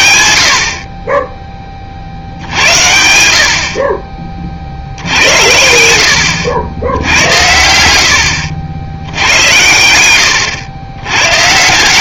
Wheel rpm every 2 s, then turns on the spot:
30, 80, 80, 90, 90, 90.
none